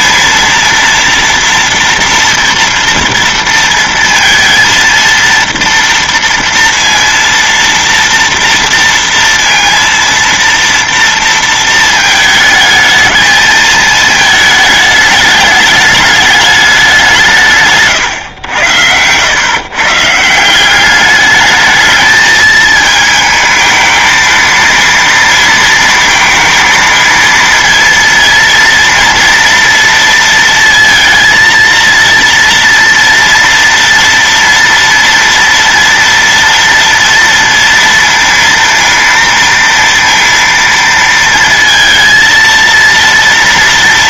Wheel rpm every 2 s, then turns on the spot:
230, 230, 230, 230, 230, 230, 220, 220, 200, 100, 180, 220, 230, 230, 230, 230, 230, 230, 230, 230, 230, 230.
none